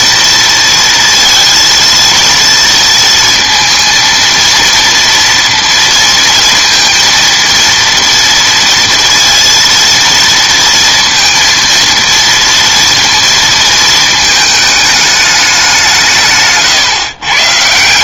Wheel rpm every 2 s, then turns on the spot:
230, 230, 230, 230, 230, 230, 230, 220, 130.
none